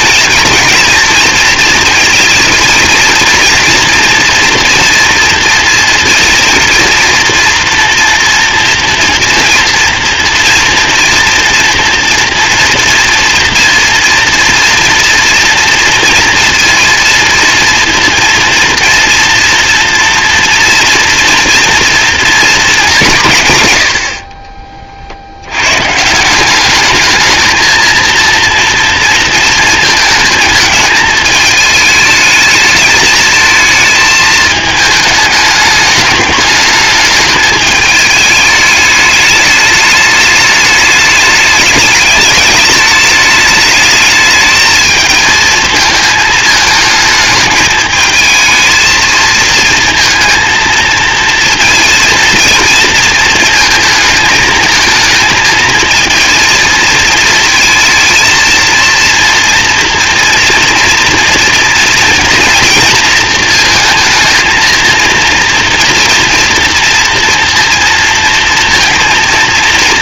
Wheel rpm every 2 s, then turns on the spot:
230, 230, 230, 230, 230, 230, 230, 230, 230, 240, 230, 210, 40, 210, 230, 220, 220, 220, 210, 210, 210, 210, 220, 220, 220, 220, 230, 220, 230, 230, 230, 230, 230, 240, 230.
none